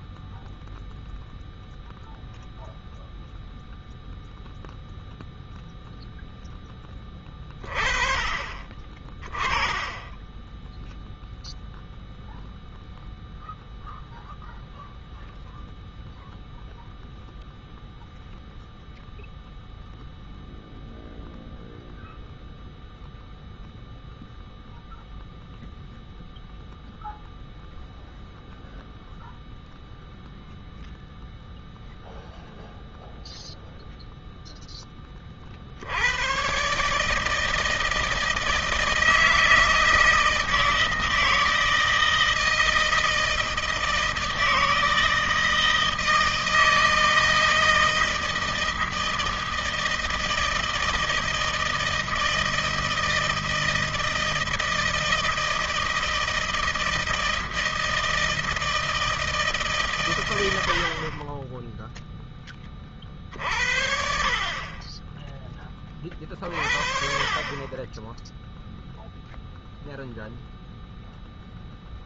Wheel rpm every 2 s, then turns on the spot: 0, 0, 0, 10, 30, 10, 0, 0, 0, 0, 0, 0, 0, 0, 0, 0, 0, 0, 130, 160, 160, 160, 160, 160, 160, 160, 160, 160, 160, 160, 80, 20, 40, 40, 0, 0.
none